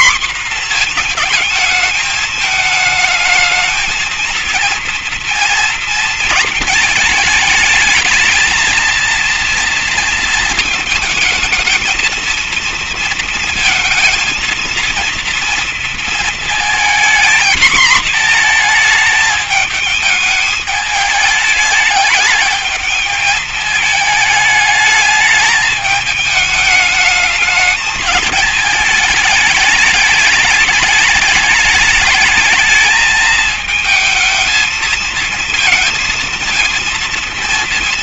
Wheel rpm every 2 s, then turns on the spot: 230, 220, 230, 220, 230, 220, 230, 230, 220, 220, 210, 210, 210, 210, 220, 210, 220, 220, 230.
none